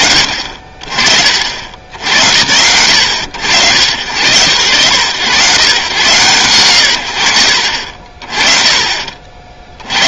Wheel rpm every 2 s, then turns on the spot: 40, 100, 100, 90, 30.
none